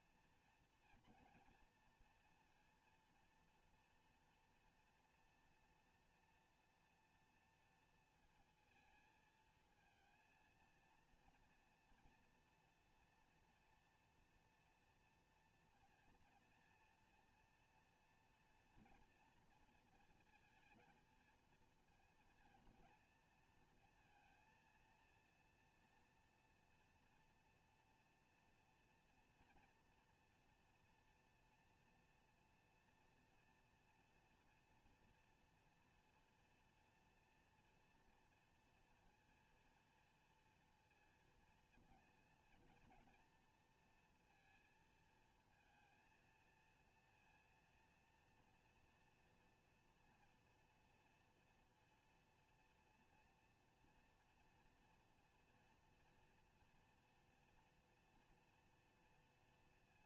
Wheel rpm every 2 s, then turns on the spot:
240, 230, 230, 230, 230, 230, 230, 230, 230, 230, 230, 230, 230, 230, 230, 230, 230, 240, 240, 230, 230, 230, 230, 230, 240, 240, 230, 230, 230, 230.
none